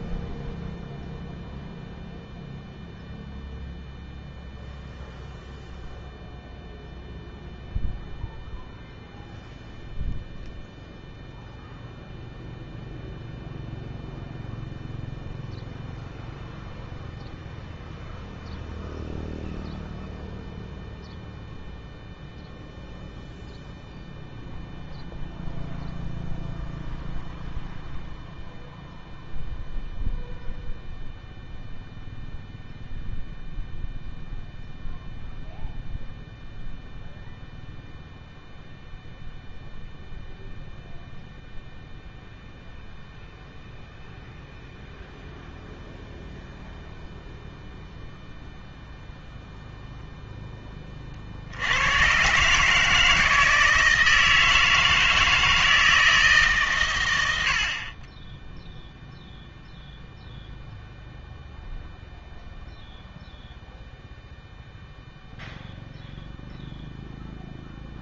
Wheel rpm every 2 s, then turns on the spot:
0, 0, 0, 0, 0, 0, 0, 0, 0, 0, 0, 0, 0, 0, 0, 0, 0, 0, 0, 0, 0, 0, 0, 0, 0, 10, 130, 160, 140, 10, 0, 0, 0, 0.
none